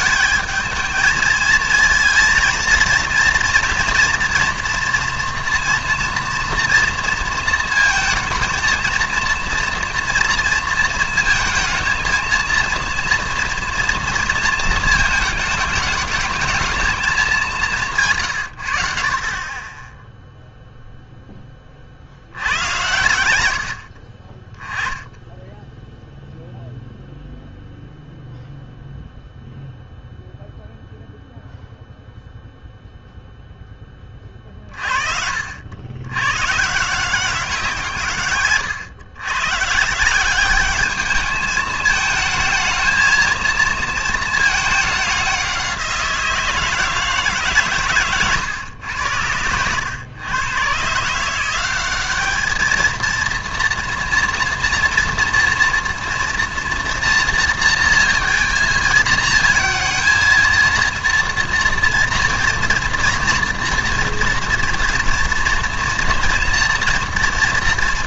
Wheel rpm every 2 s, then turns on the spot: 220, 230, 240, 230, 230, 230, 230, 220, 220, 90, 0, 90, 20, 0, 0, 0, 0, 40, 140, 130, 200, 220, 220, 160, 120, 120, 220, 230, 240, 230, 230, 230, 230, 230.
none